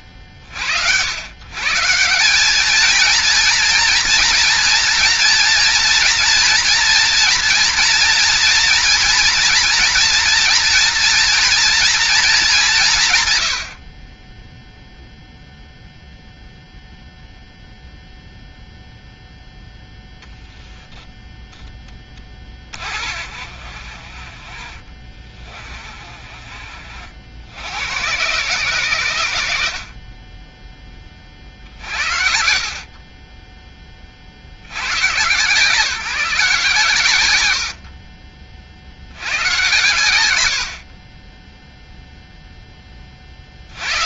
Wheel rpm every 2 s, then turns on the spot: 70, 220, 230, 230, 240, 230, 190, 0, 0, 0, 0, 40, 30, 50, 100, 30, 30, 110, 120, 80, 30, 20.
22-26